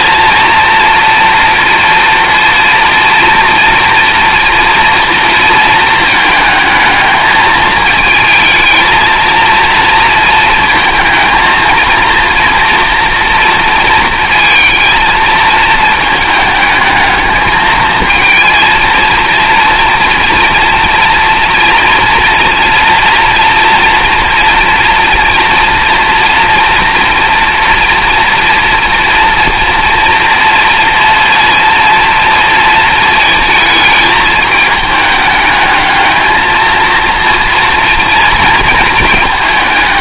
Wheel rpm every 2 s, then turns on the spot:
230, 230, 220, 220, 230, 230, 230, 220, 220, 230, 240, 230, 230, 230, 230, 230, 220, 220, 230, 230.
none